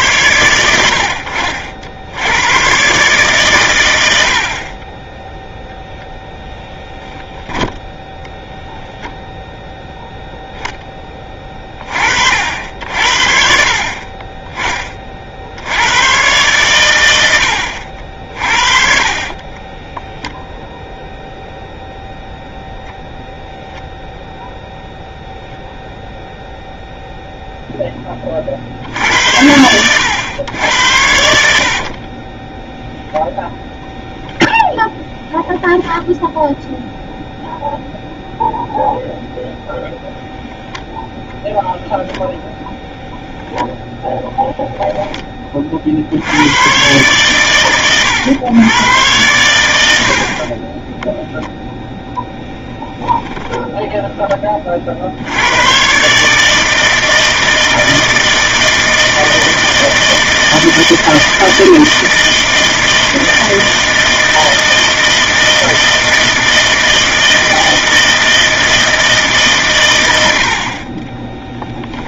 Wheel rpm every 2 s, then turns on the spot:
100, 120, 20, 0, 0, 10, 70, 20, 110, 50, 0, 0, 0, 0, 50, 100, 10, 0, 0, 0, 0, 0, 0, 120, 110, 20, 10, 50, 160, 160, 160, 160, 160, 160, 160, 40.
18-20 52-54 70-72